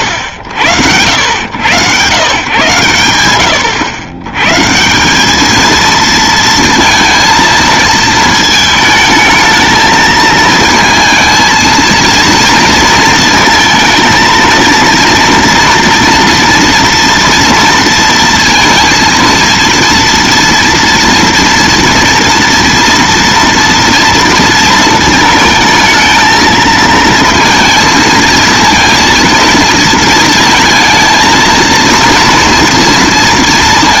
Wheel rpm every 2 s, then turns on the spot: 90, 130, 140, 230, 220, 220, 230, 230, 230, 230, 230, 230, 230, 220, 230, 220, 230.
none